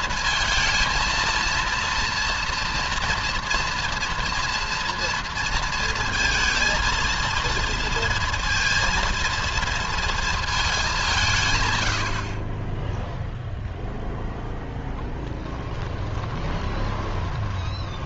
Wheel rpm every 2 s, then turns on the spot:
230, 230, 230, 230, 230, 190, 10, 30, 20.
14-18